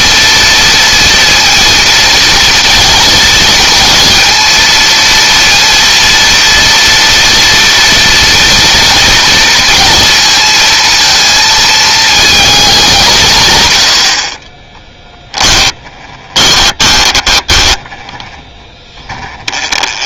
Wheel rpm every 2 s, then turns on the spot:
230, 230, 230, 230, 230, 230, 190, 10, 20, 10.
14-18